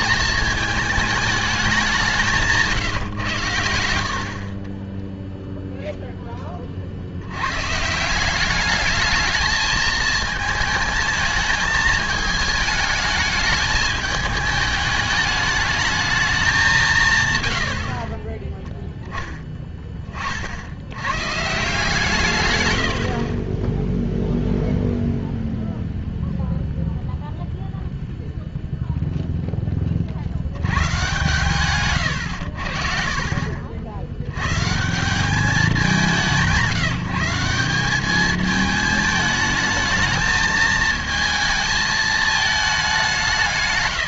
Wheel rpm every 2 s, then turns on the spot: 220, 160, 30, 40, 210, 220, 220, 210, 190, 0, 70, 90, 0, 0, 0, 100, 60, 130, 180, 220, 220, 210.
none